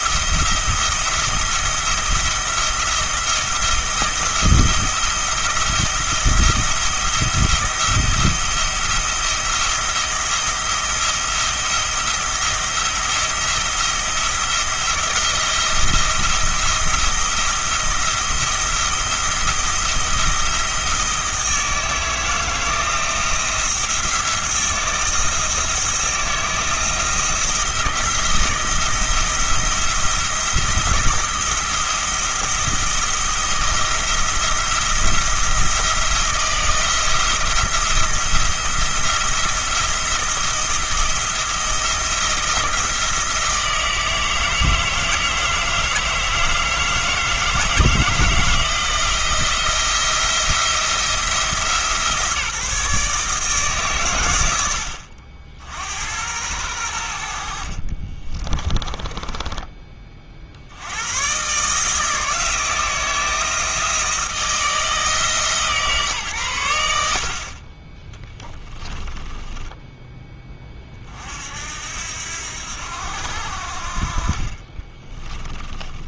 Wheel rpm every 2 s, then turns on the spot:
170, 170, 170, 170, 170, 170, 170, 170, 170, 170, 170, 160, 170, 160, 170, 170, 170, 170, 170, 170, 170, 160, 160, 160, 160, 170, 160, 80, 100, 20, 70, 170, 160, 100, 10, 30, 80, 30.
58-60 68-70 74-76